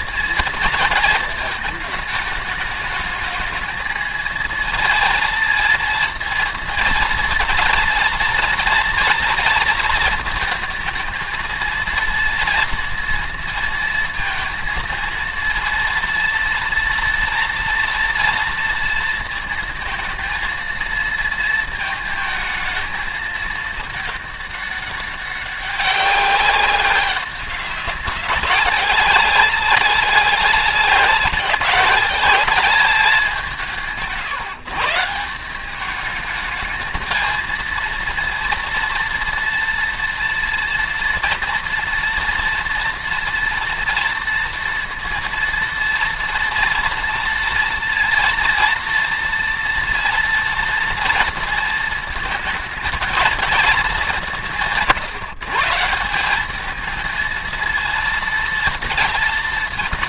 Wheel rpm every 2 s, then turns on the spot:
230, 210, 220, 230, 230, 220, 230, 230, 230, 230, 230, 220, 210, 190, 200, 190, 200, 150, 220, 230, 230, 230, 230, 230, 230, 230, 220, 180, 200, 230.
none